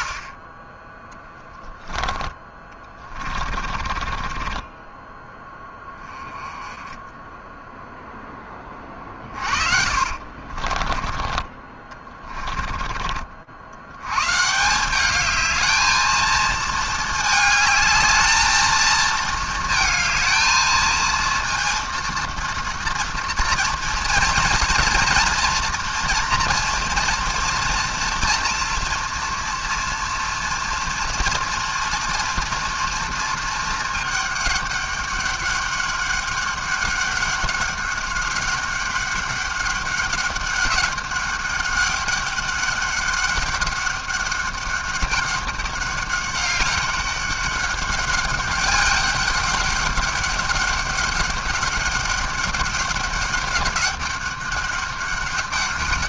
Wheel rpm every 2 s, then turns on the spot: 20, 20, 20, 10, 10, 40, 30, 150, 220, 220, 220, 230, 230, 230, 230, 230, 230, 210, 200, 200, 190, 200, 200, 200, 200, 200, 200, 200.
2-6 10-14